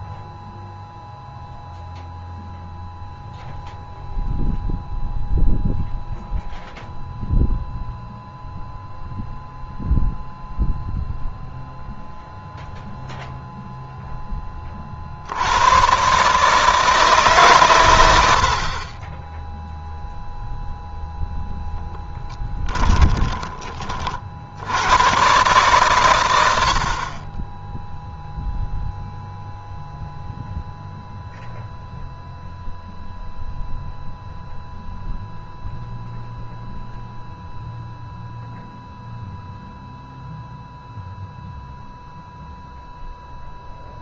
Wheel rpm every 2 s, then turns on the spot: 0, 0, 0, 0, 0, 0, 0, 60, 160, 30, 0, 10, 100, 50, 0, 0, 0, 0, 0, 0, 0, 0.
22-24